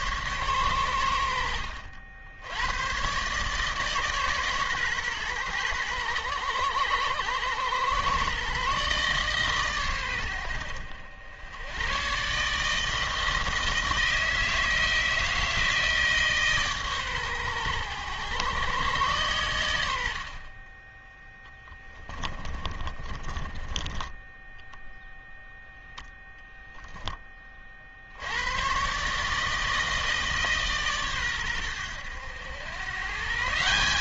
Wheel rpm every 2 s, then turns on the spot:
100, 110, 130, 110, 140, 80, 160, 160, 140, 120, 20, 20, 0, 10, 130, 140, 110.
22-24